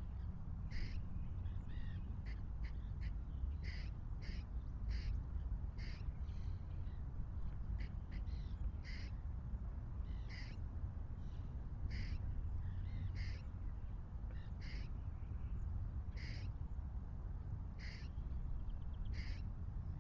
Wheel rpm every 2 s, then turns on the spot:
0, 0, 0, 0, 0, 0, 0, 0, 0, 0.
none